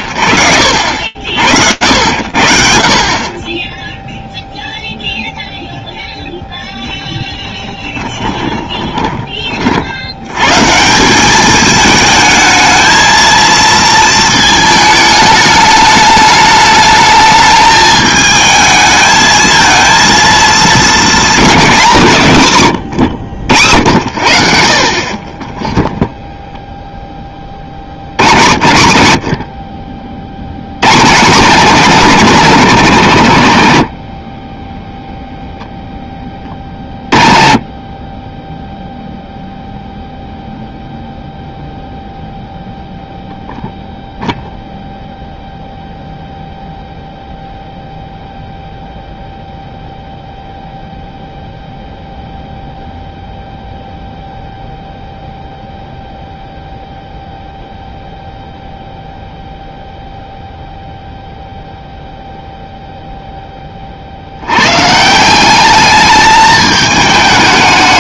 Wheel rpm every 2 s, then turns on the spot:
80, 10, 0, 0, 30, 200, 230, 210, 210, 220, 230, 100, 30, 40, 60, 160, 100, 0, 20, 0, 0, 0, 0, 0, 0, 0, 0, 0, 0, 0, 0, 0, 110, 210.
2-4 24-26